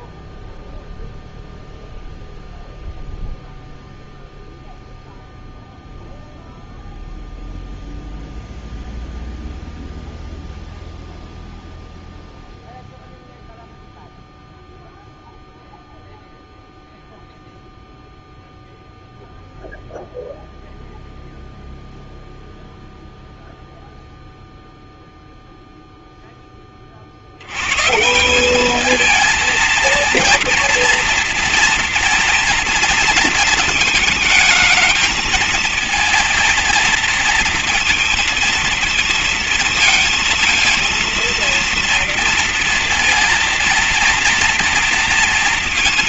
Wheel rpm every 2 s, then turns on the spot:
0, 0, 0, 0, 0, 0, 0, 0, 0, 0, 0, 0, 0, 20, 190, 230, 230, 220, 230, 230, 230, 230, 230.
none